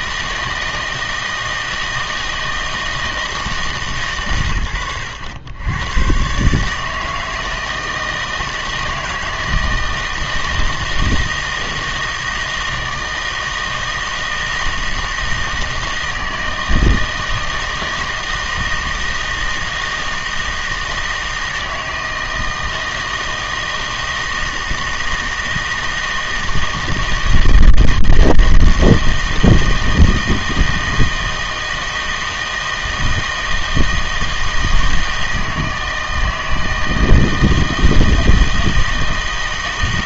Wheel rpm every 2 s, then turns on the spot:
160, 160, 110, 150, 160, 160, 160, 160, 160, 160, 160, 160, 160, 160, 160, 160, 160, 160, 160, 160.
none